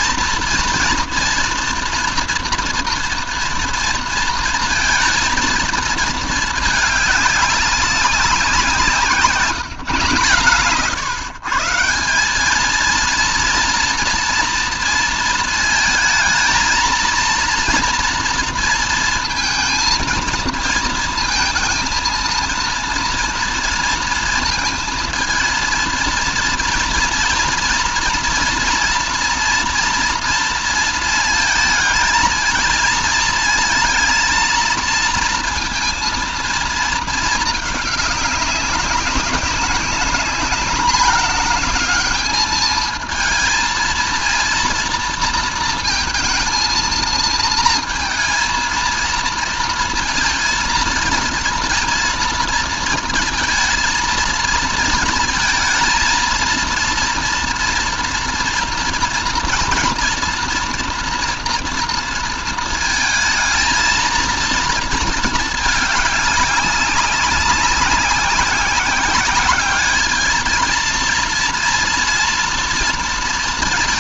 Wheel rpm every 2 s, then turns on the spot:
230, 230, 230, 210, 180, 130, 210, 230, 220, 230, 220, 230, 220, 230, 230, 230, 230, 230, 230, 200, 210, 220, 230, 220, 220, 230, 230, 220, 230, 230, 230, 220, 230, 200, 190, 230, 230.
none